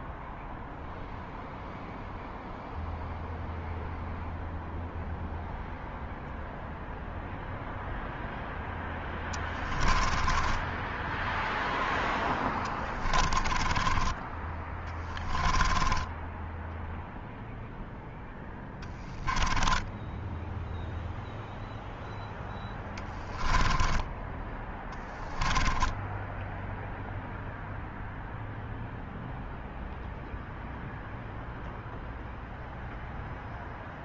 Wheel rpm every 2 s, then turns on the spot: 0, 0, 0, 0, 10, 10, 20, 20, 0, 10, 0, 20, 10, 0, 0, 0, 0.
8-16 22-26